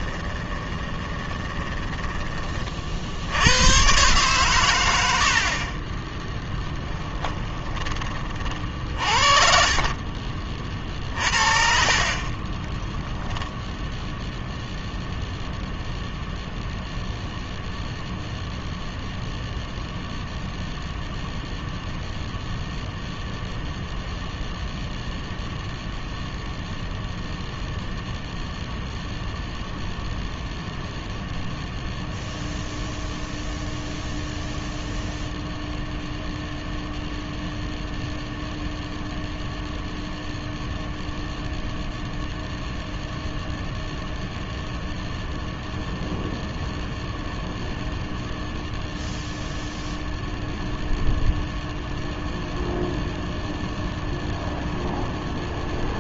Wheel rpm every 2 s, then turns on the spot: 20, 40, 100, 10, 50, 40, 10, 0, 0, 0, 0, 0, 0, 0, 0, 0, 0, 0, 0, 0, 0, 0, 0, 0, 0, 0, 0, 0.
0-2 6-8 10-14